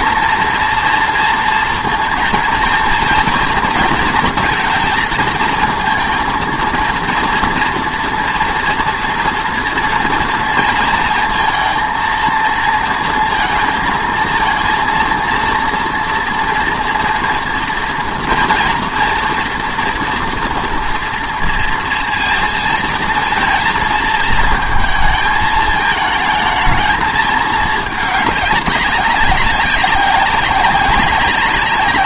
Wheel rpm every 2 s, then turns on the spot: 230, 230, 230, 230, 230, 230, 230, 230, 230, 240, 230, 230, 220, 220, 200, 190.
none